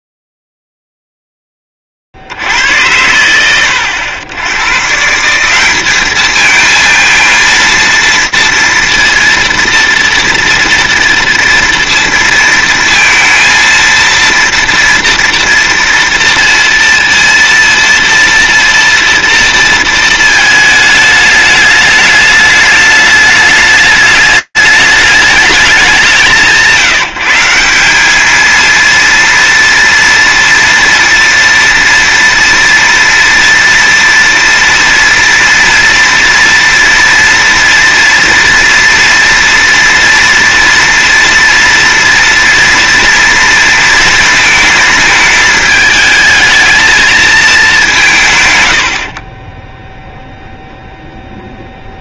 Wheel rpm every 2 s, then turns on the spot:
0, 10, 100, 190, 230, 230, 230, 230, 230, 230, 230, 210, 210, 190, 200, 230, 230, 230, 230, 230, 230, 230, 230, 220, 170, 0.
none